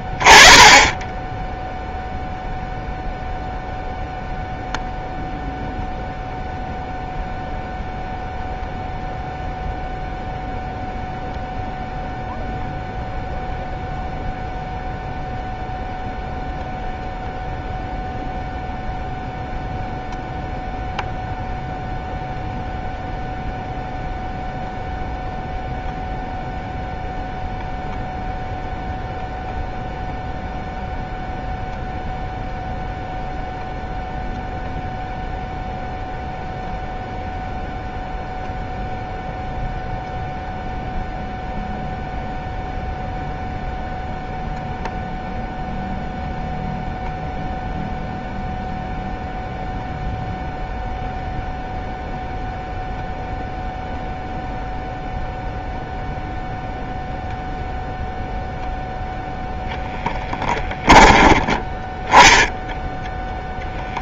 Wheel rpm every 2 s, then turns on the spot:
10, 0, 0, 0, 0, 0, 0, 0, 0, 0, 0, 0, 0, 0, 0, 0, 0, 0, 0, 0, 0, 0, 0, 0, 0, 0, 0, 0, 0, 0, 10, 0.
60-62